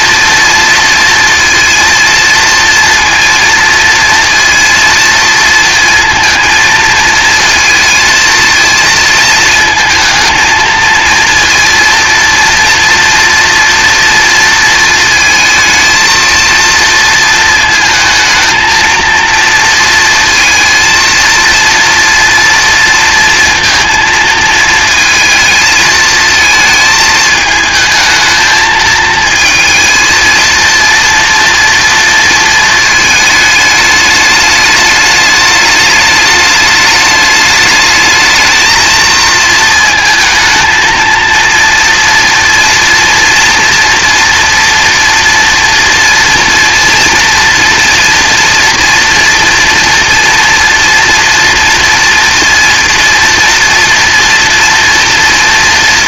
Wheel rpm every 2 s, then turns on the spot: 230, 230, 230, 230, 230, 230, 230, 230, 230, 230, 230, 230, 230, 220, 220, 230, 220, 210, 210, 220, 230, 240, 240, 230, 240, 240, 230, 230.
none